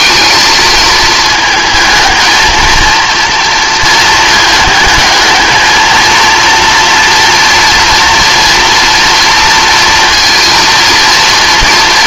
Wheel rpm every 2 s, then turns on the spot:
220, 230, 220, 230, 230, 230.
none